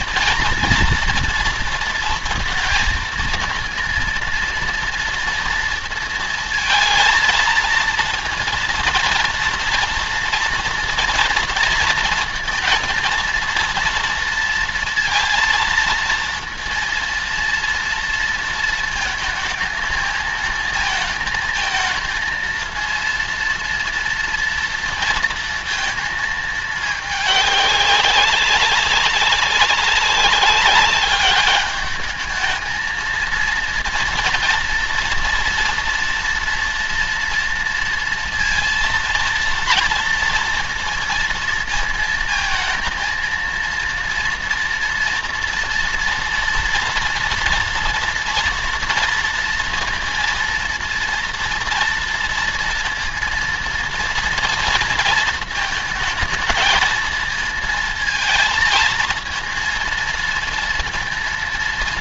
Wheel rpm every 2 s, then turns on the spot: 240, 230, 230, 230, 230, 230, 230, 230, 230, 230, 220, 230, 230, 220, 200, 200, 220, 230, 230, 230, 230, 230, 230, 240, 230, 230, 230, 230, 220, 220, 230.
none